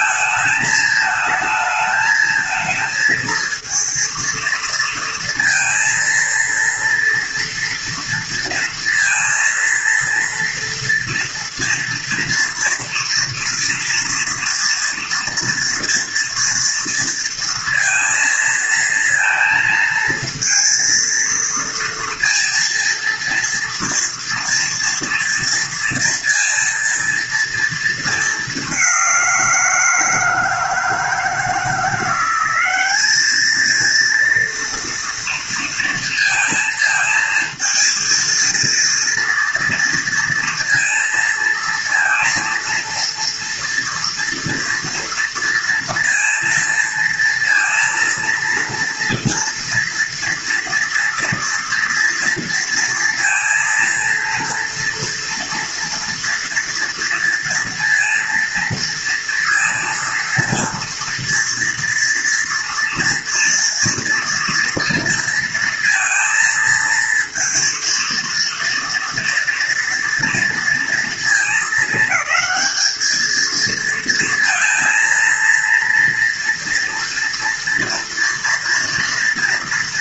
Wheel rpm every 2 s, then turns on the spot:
220, 230, 230, 230, 230, 230, 230, 230, 230, 220, 230, 230, 230, 230, 200, 160, 190, 230, 230, 230, 230, 230, 230, 230, 230, 240, 230, 230, 240, 230, 230, 230, 230, 230, 230, 230, 220, 230, 230, 230.
none